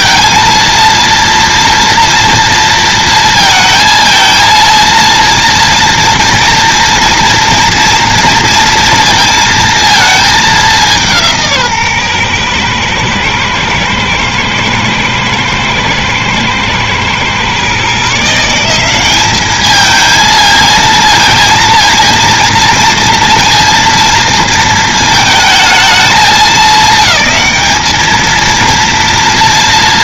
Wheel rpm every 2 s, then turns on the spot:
230, 230, 230, 230, 230, 200, 120, 110, 110, 170, 220, 230, 230, 210, 230.
none